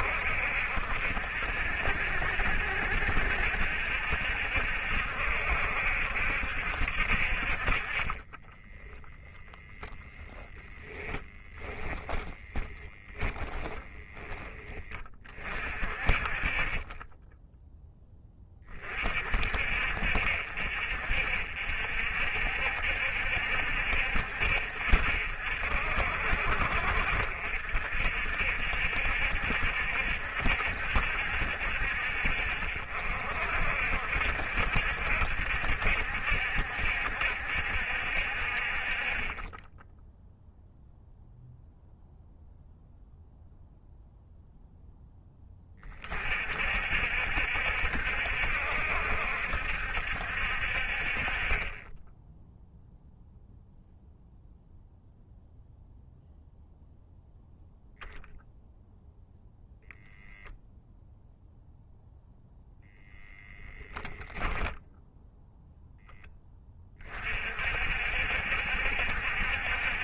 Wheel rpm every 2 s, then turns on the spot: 60, 70, 70, 60, 10, 10, 10, 20, 20, 30, 60, 60, 60, 60, 70, 70, 60, 70, 70, 50, 0, 0, 10, 60, 70, 50, 0, 0, 0, 0, 0, 0, 0, 20, 70.
8-14